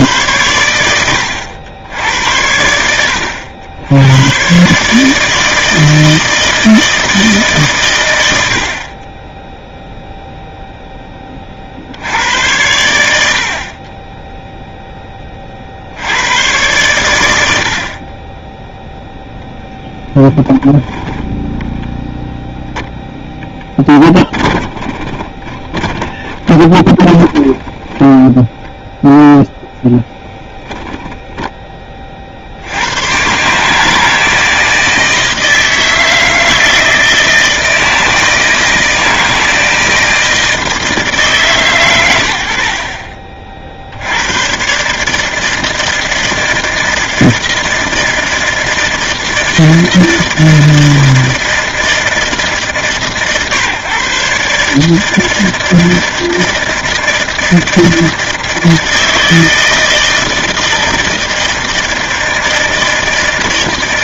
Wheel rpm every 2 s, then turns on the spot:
80, 100, 160, 100, 0, 70, 20, 50, 70, 0, 10, 10, 30, 20, 0, 10, 120, 160, 160, 160, 150, 40, 150, 160, 160, 160, 130, 160, 160, 160, 160, 160.
22-28